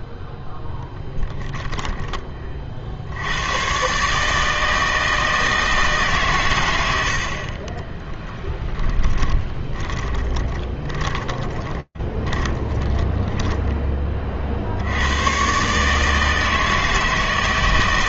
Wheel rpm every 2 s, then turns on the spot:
0, 40, 160, 110, 10, 20, 10, 60, 160.
8-14